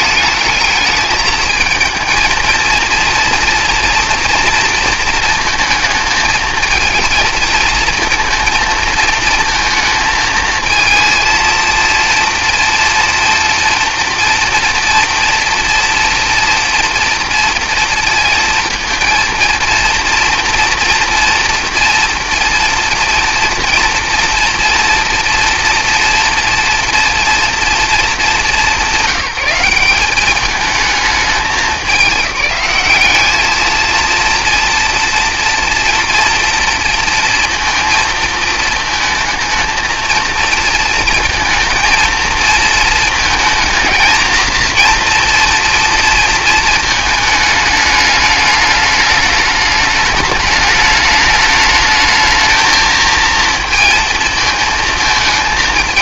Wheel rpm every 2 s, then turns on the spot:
220, 230, 230, 220, 230, 230, 240, 230, 230, 230, 230, 230, 240, 230, 190, 220, 200, 230, 230, 220, 230, 220, 230, 220, 210, 210, 220, 220.
none